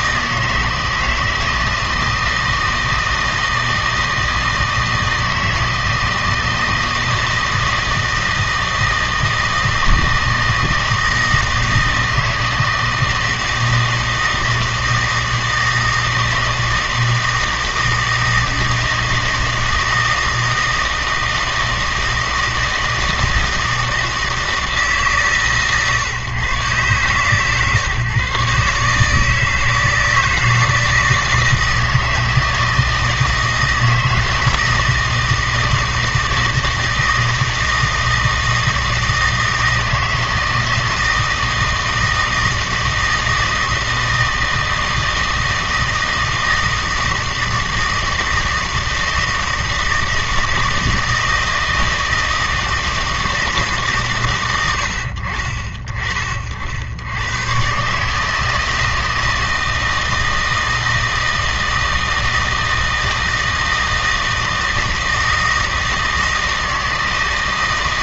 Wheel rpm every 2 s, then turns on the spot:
160, 160, 160, 160, 160, 160, 160, 160, 160, 160, 160, 160, 150, 130, 150, 160, 160, 160, 160, 160, 160, 160, 160, 160, 160, 160, 160, 90, 80, 160, 160, 160, 160, 160.
none